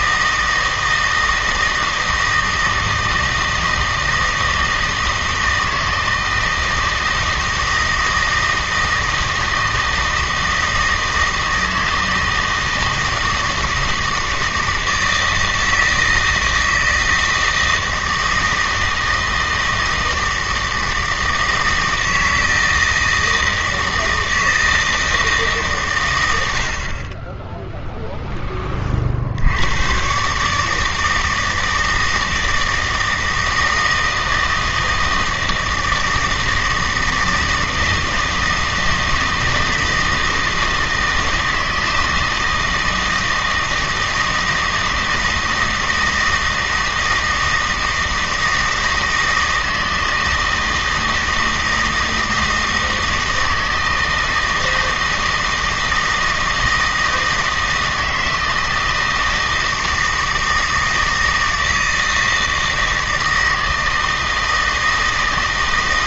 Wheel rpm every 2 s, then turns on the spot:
160, 160, 160, 160, 160, 160, 160, 160, 160, 160, 160, 160, 160, 30, 50, 160, 160, 160, 160, 160, 160, 160, 160, 160, 160, 160, 160, 160, 160, 160, 160, 160, 160.
none